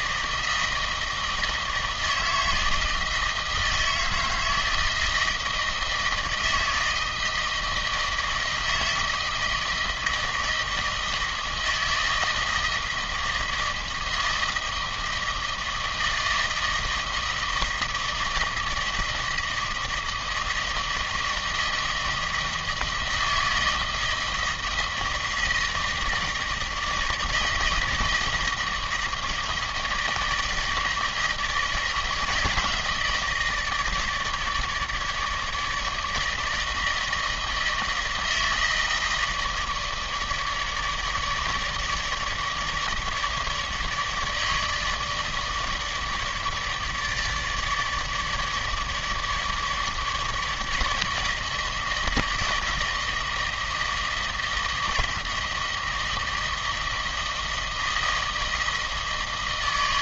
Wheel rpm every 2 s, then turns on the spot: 160, 160, 160, 160, 160, 160, 160, 160, 160, 160, 160, 160, 160, 160, 160, 160, 160, 150, 160, 160, 150, 160, 150, 150, 150, 160, 160, 160, 160, 160.
none